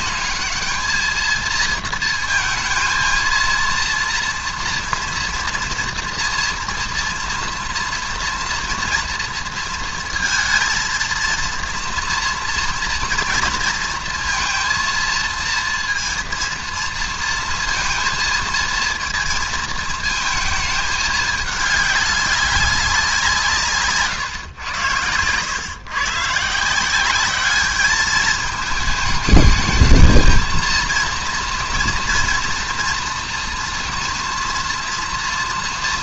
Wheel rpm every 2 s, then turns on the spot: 220, 230, 230, 240, 230, 230, 230, 230, 230, 230, 220, 190, 120, 150, 220, 220, 230, 230.
none